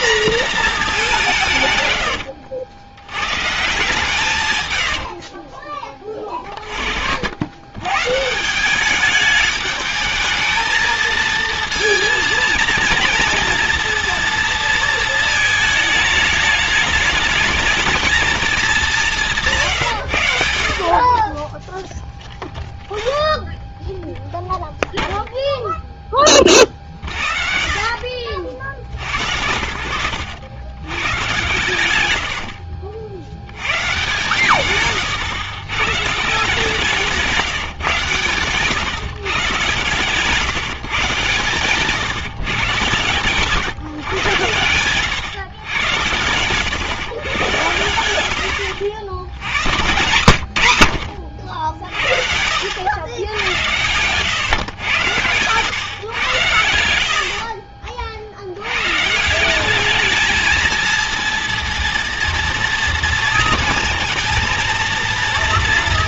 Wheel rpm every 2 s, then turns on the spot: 230, 80, 110, 40, 180, 220, 230, 230, 210, 210, 60, 20, 0, 50, 60, 100, 70, 120, 170, 130, 160, 140, 110, 110, 90, 90, 80, 120, 80, 110, 220, 230, 230.
4-6 26-28 32-36 56-58